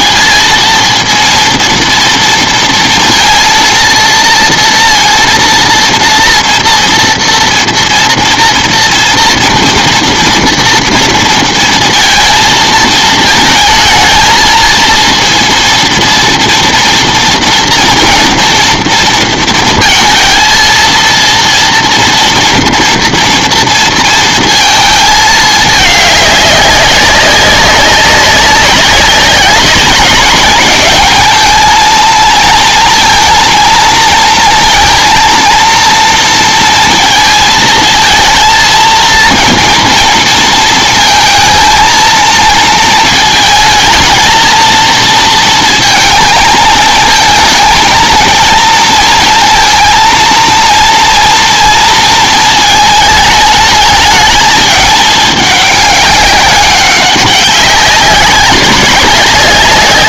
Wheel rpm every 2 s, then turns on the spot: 220, 230, 230, 230, 230, 240, 230, 230, 230, 230, 230, 230, 230, 200, 190, 190, 230, 230, 220, 220, 220, 230, 220, 220, 230, 230, 220, 210, 200, 200.
none